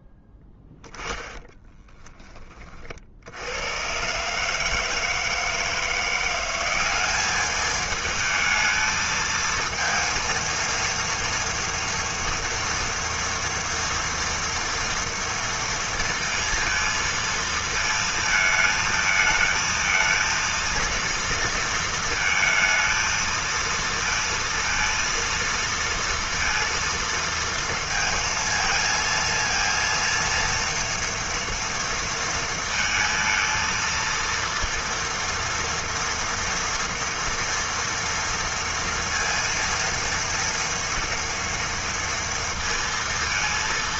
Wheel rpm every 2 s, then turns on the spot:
20, 30, 160, 190, 220, 230, 230, 230, 230, 220, 230, 230, 230, 230, 220, 230, 230, 230, 230, 230, 230, 230.
0-2